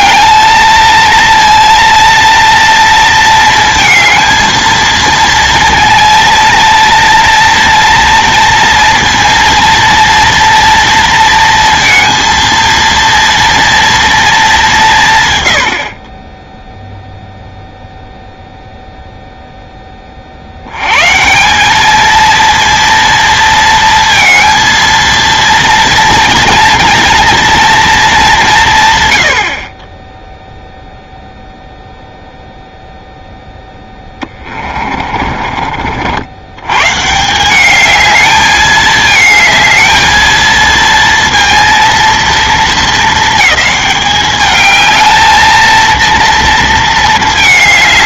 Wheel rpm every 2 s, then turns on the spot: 220, 230, 230, 230, 230, 230, 230, 190, 0, 0, 90, 230, 230, 230, 160, 0, 0, 30, 110, 220, 230, 220, 210, 230.
34-36